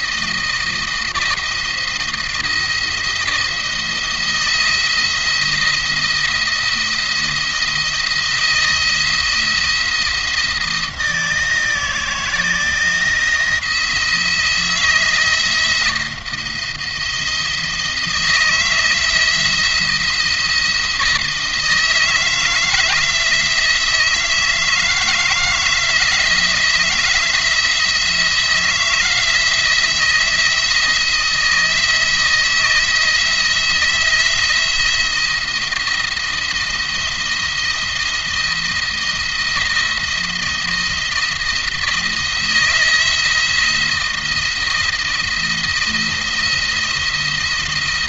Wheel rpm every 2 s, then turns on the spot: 170, 170, 170, 170, 160, 170, 170, 170, 170, 170, 170, 160, 170, 170, 170, 170, 160, 170, 170, 170, 170, 160, 170, 170.
none